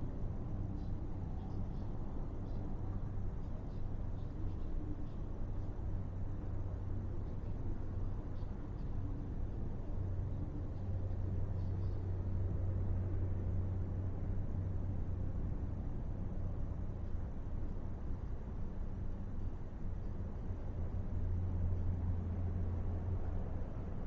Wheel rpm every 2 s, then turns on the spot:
0, 0, 0, 0, 0, 0, 0, 0, 0, 0, 0, 0.
none